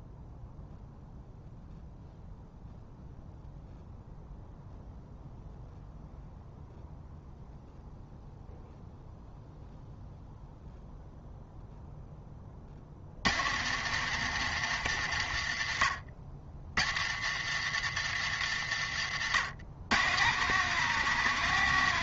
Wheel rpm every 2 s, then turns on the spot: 0, 0, 0, 0, 0, 0, 80, 100, 90, 100, 160.
18-20